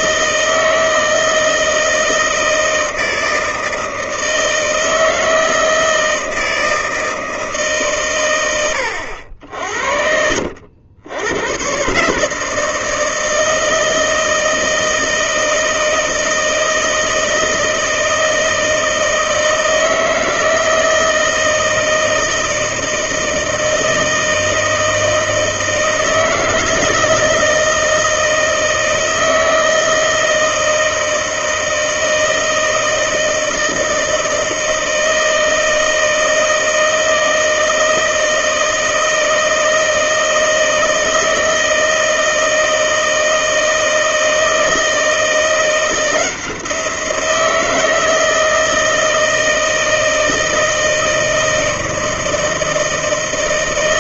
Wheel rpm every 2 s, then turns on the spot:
160, 160, 160, 160, 100, 80, 160, 160, 160, 160, 160, 160, 160, 160, 160, 160, 160, 160, 160, 160, 160, 160, 160, 170, 160, 160, 160.
none